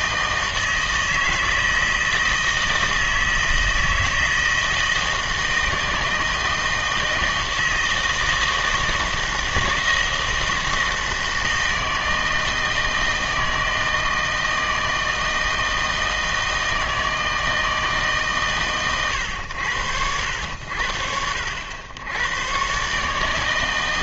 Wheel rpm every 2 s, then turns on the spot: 160, 160, 160, 160, 160, 160, 160, 160, 160, 120, 80, 130.
none